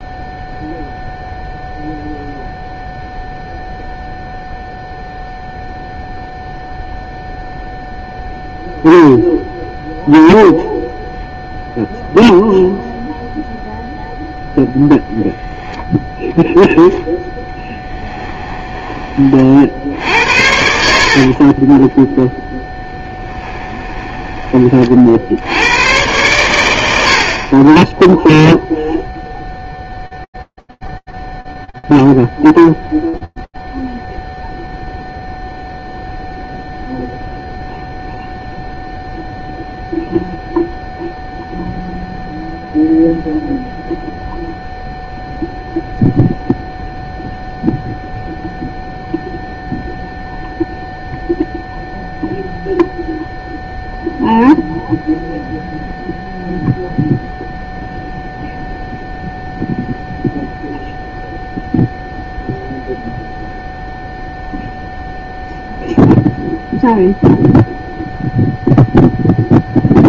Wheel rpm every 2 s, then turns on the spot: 0, 0, 0, 0, 0, 0, 0, 0, 0, 10, 40, 30, 10, 90, 30, 0, 0, 0, 0, 0, 0, 0, 0, 0, 0, 0, 0, 0, 0, 0, 0, 0, 0, 0, 0.
22-26